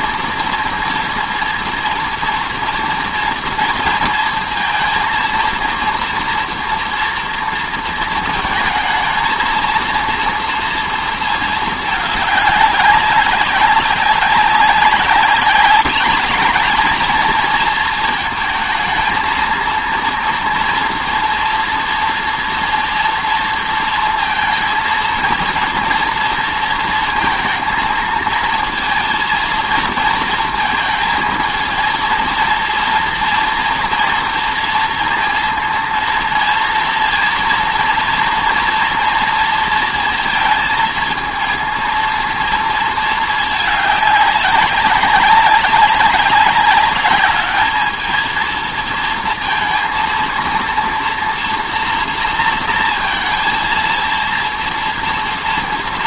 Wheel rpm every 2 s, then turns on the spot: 230, 230, 230, 230, 220, 230, 200, 190, 210, 220, 230, 230, 230, 230, 230, 220, 230, 230, 230, 230, 230, 230, 200, 200, 220, 230, 230, 230.
none